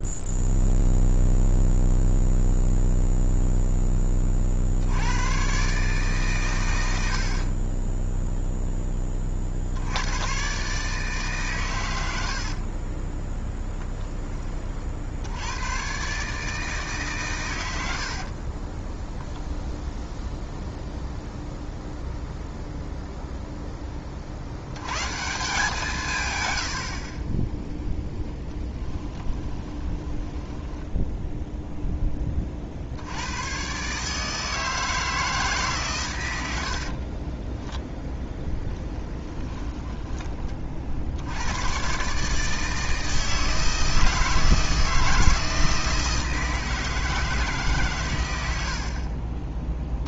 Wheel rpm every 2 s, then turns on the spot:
0, 0, 80, 90, 10, 140, 30, 60, 150, 10, 0, 0, 120, 60, 20, 10, 70, 160, 50, 10, 50, 160, 160, 160, 60.
12-14 18-20 26-32 36-40